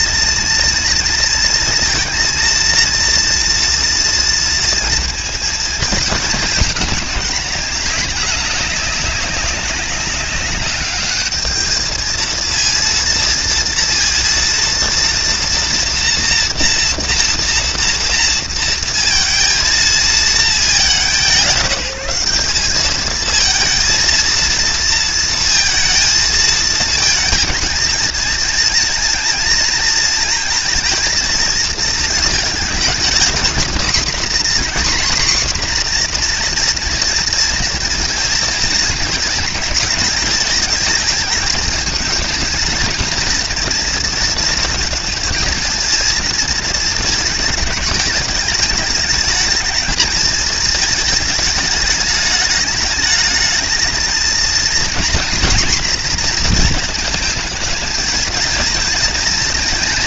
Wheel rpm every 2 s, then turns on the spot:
230, 230, 230, 220, 200, 200, 230, 230, 240, 230, 220, 200, 230, 230, 230, 230, 220, 250, 240, 230, 220, 230, 230, 230, 210, 220, 210, 230, 230, 230.
none